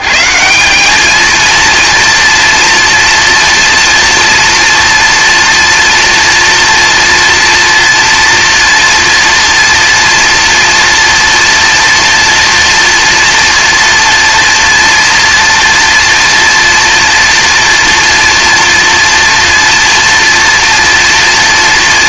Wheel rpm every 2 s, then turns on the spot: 200, 230, 230, 230, 230, 230, 230, 230, 240, 230, 240.
none